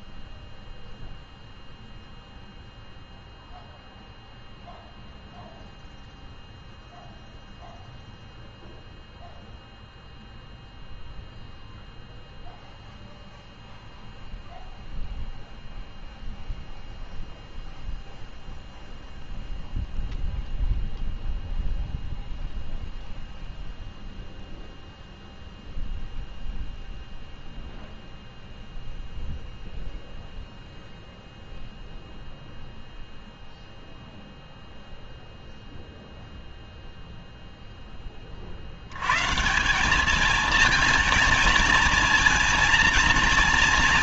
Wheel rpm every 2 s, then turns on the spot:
0, 0, 0, 0, 0, 0, 0, 0, 0, 0, 0, 0, 0, 0, 0, 0, 0, 0, 0, 50, 220, 230.
none